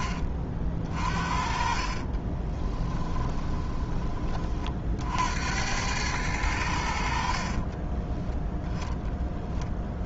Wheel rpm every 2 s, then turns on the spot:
40, 20, 40, 90, 0.
2-4